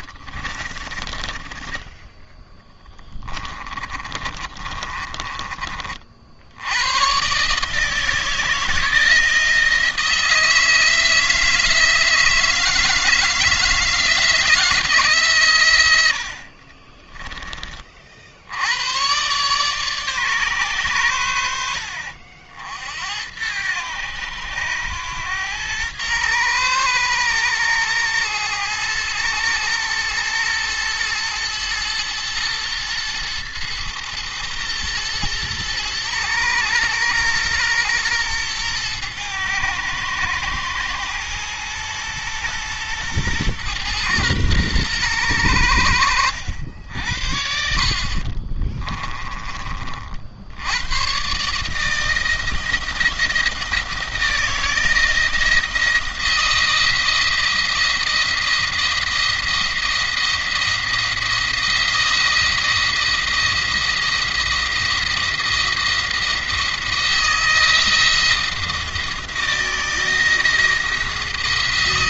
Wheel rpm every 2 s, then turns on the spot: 20, 20, 30, 100, 160, 160, 160, 160, 40, 100, 110, 70, 100, 110, 110, 110, 110, 120, 110, 110, 110, 120, 110, 60, 20, 110, 160, 160, 160, 170, 170, 170, 170, 170, 160, 160.
0-6 16-18 48-50